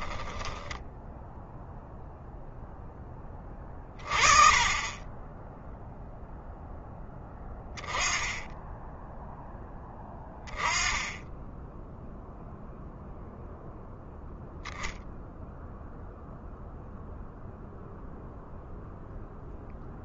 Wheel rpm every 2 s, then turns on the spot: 10, 10, 20, 10, 10, 10, 0, 0, 0, 0.
0-2